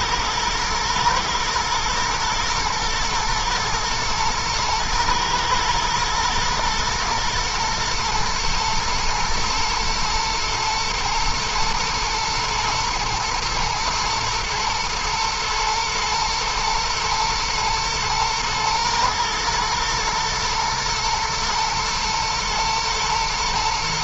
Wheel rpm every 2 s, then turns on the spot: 120, 110, 110, 110, 110, 110, 110, 110, 110, 110, 110, 120.
none